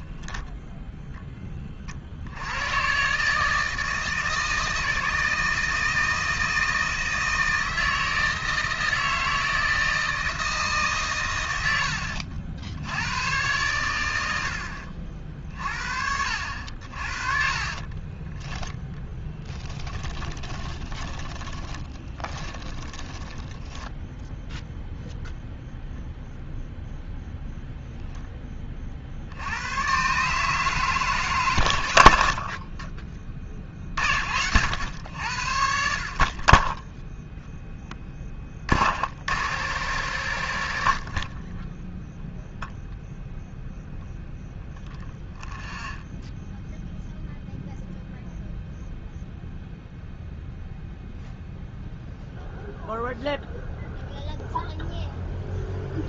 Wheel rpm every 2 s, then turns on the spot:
30, 160, 160, 160, 160, 80, 100, 60, 30, 10, 30, 10, 0, 0, 80, 120, 40, 70, 0, 90, 10, 0, 0, 0, 0, 0, 0, 0.
10-12 16-24